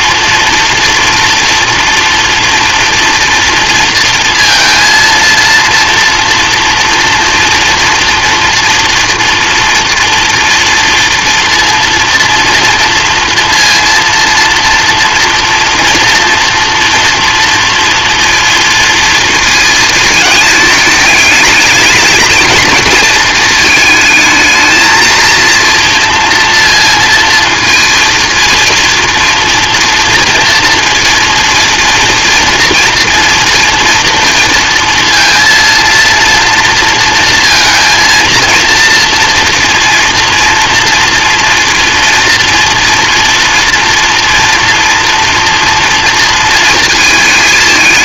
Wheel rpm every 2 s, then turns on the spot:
230, 230, 230, 230, 230, 230, 230, 230, 230, 230, 210, 220, 230, 230, 240, 230, 230, 230, 230, 230, 230, 230, 240, 220.
none